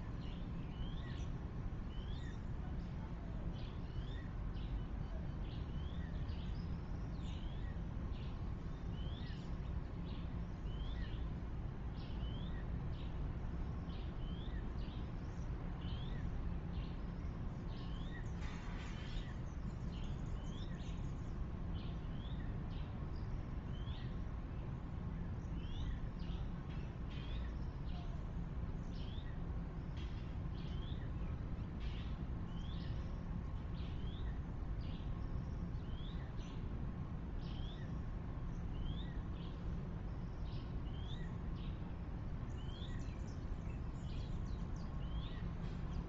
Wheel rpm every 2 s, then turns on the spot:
0, 0, 0, 0, 0, 0, 0, 0, 0, 0, 0, 0, 0, 0, 0, 0, 0, 0, 0, 0, 0, 0, 0.
none